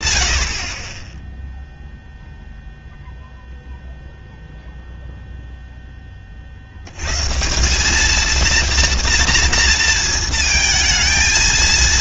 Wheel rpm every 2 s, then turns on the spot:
60, 0, 0, 40, 230, 230.
none